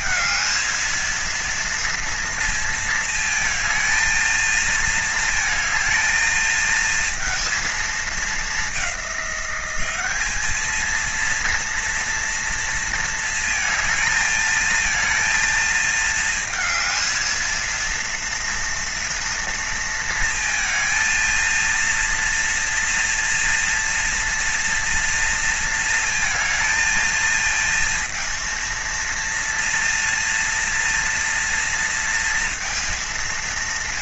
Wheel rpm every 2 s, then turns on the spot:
230, 230, 220, 220, 200, 220, 230, 230, 230, 230, 220, 230, 230, 230, 230, 230, 230.
none